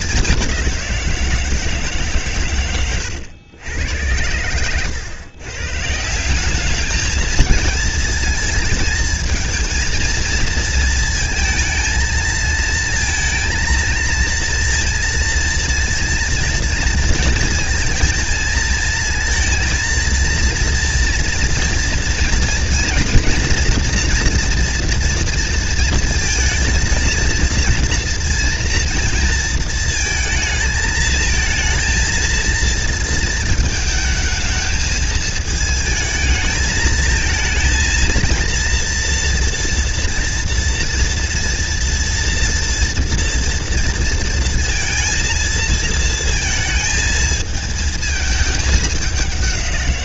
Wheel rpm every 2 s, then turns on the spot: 170, 110, 110, 220, 230, 220, 230, 230, 230, 220, 240, 240, 230, 230, 230, 220, 230, 220, 220, 230, 230, 230, 230, 220, 200.
none